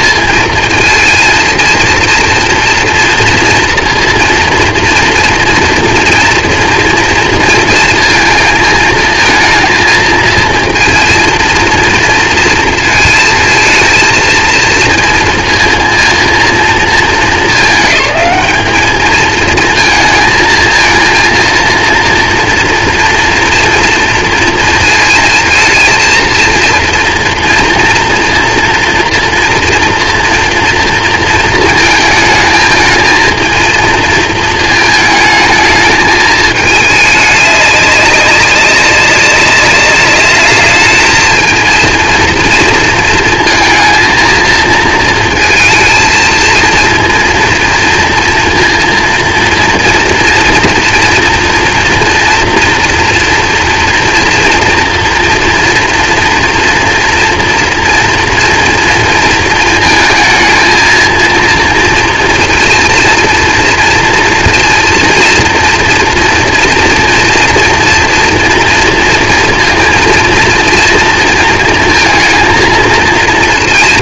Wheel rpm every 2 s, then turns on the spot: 220, 230, 230, 240, 230, 220, 230, 230, 230, 210, 220, 230, 230, 230, 230, 230, 220, 220, 220, 200, 210, 230, 230, 230, 230, 230, 230, 240, 230, 230, 220, 230, 230, 230, 230, 230, 230.
none